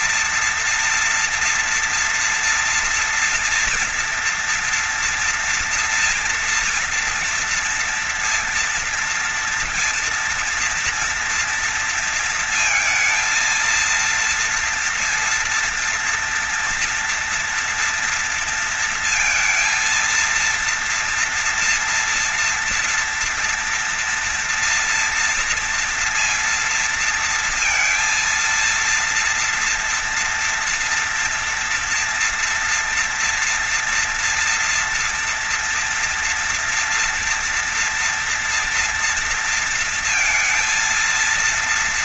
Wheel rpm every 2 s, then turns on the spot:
230, 230, 230, 230, 230, 230, 220, 230, 230, 230, 230, 230, 230, 230, 230, 230, 230, 240, 230, 230, 230.
none